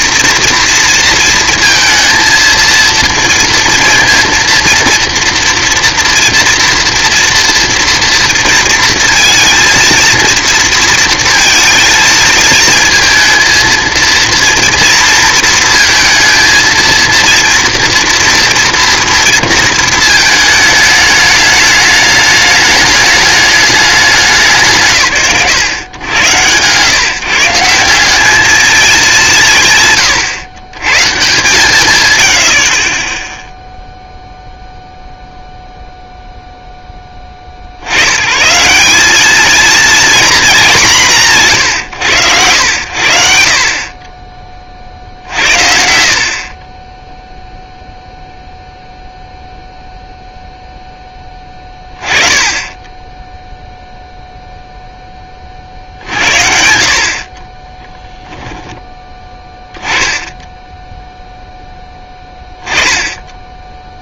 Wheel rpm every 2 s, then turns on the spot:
230, 230, 230, 230, 230, 230, 220, 230, 220, 230, 220, 210, 130, 140, 220, 140, 50, 0, 0, 150, 220, 100, 40, 20, 0, 10, 20, 0, 60, 10, 10, 10.
60-62